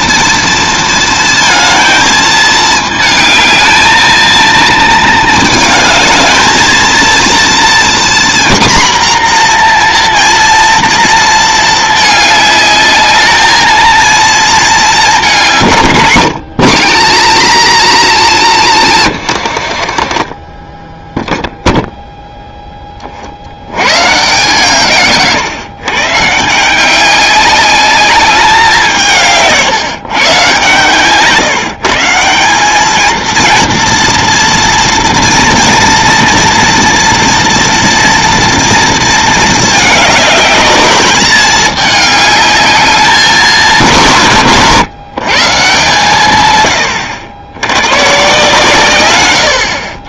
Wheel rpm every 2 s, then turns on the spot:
230, 220, 230, 220, 240, 230, 210, 220, 210, 220, 20, 10, 130, 170, 190, 140, 200, 240, 240, 230, 210, 210, 130, 110, 140.
20-22